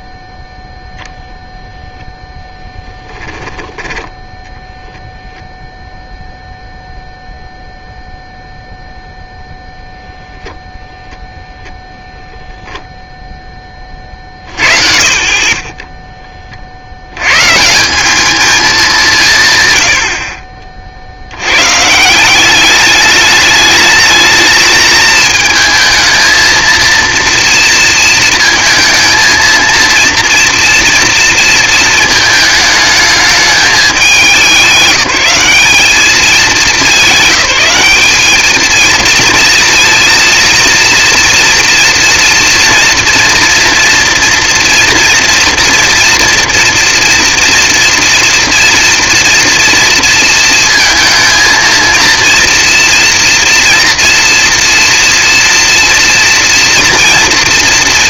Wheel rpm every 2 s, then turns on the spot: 0, 0, 0, 0, 0, 0, 10, 40, 60, 210, 40, 210, 220, 230, 230, 230, 210, 180, 200, 220, 230, 230, 230, 230, 230, 220, 230, 230, 230.
none